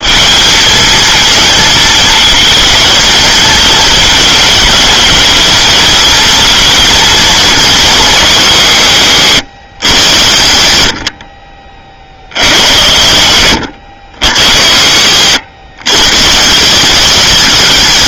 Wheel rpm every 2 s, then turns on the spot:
220, 220, 210, 230, 140, 80, 80, 100, 180.
none